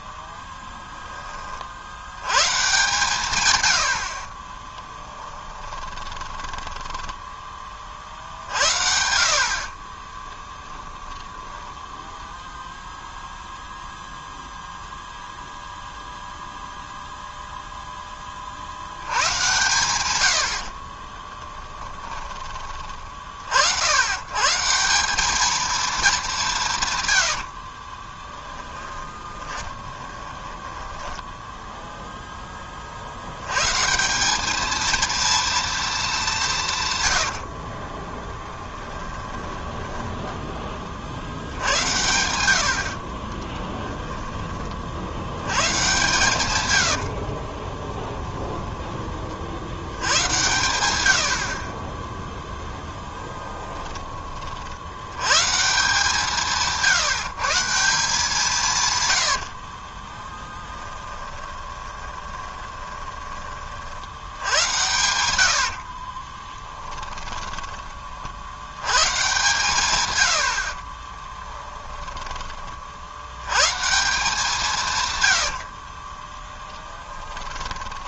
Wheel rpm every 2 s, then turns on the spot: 10, 130, 10, 10, 70, 20, 0, 0, 0, 60, 50, 50, 160, 140, 10, 20, 30, 220, 150, 20, 30, 60, 30, 100, 20, 100, 10, 70, 160, 140, 20, 20, 90, 30, 100, 50, 50, 150, 10.
4-8 10-12 20-22 28-32 38-40 52-54 60-64 66-68 70-72 76-78